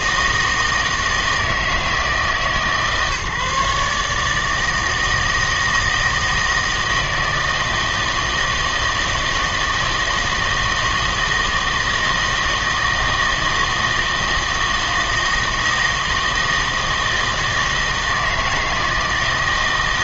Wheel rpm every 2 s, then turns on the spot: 160, 150, 160, 160, 160, 160, 160, 160, 160, 160.
none